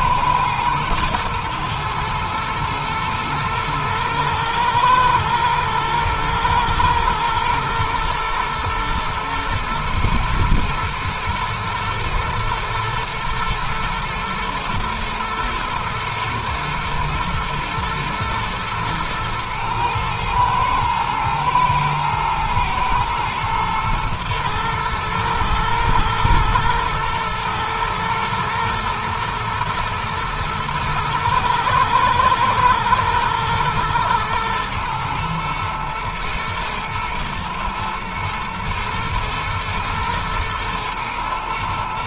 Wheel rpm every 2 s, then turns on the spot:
110, 110, 120, 120, 120, 110, 110, 120, 110, 120, 120, 110, 110, 110, 110, 110, 110, 120, 110, 110, 120.
none